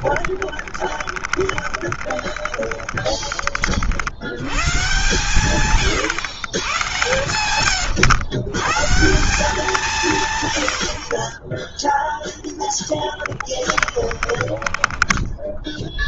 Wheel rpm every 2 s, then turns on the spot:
30, 30, 130, 120, 170, 70, 10, 20.
0-4 6-8 12-16